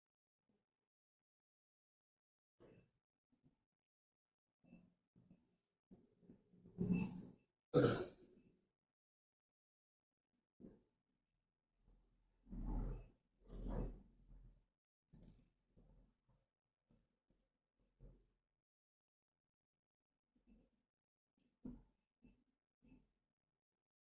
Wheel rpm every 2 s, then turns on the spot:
0, 0, 0, 0, 0, 0, 0, 0, 0, 0, 0, 0.
none